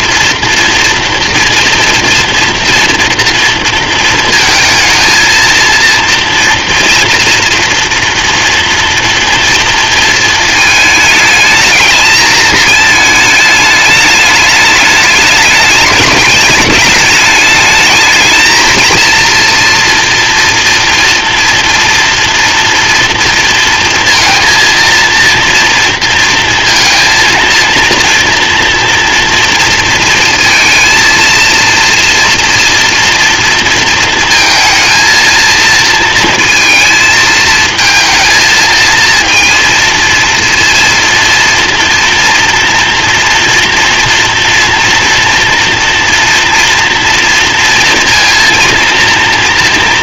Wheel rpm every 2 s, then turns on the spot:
230, 230, 230, 230, 240, 230, 220, 210, 210, 220, 230, 230, 230, 230, 230, 230, 230, 230, 220, 220, 230, 230, 230, 230, 230.
none